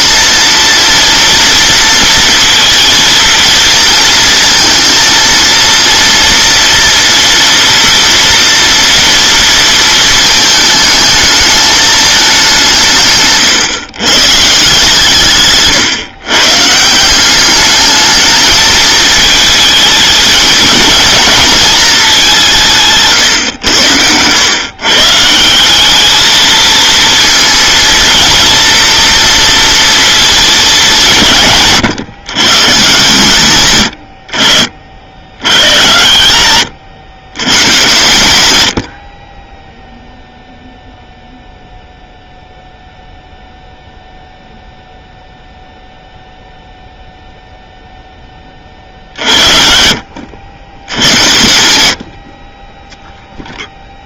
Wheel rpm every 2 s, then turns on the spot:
230, 230, 230, 230, 230, 220, 180, 150, 140, 220, 220, 180, 120, 220, 230, 210, 150, 70, 120, 90, 0, 0, 0, 0, 30, 80, 30.
none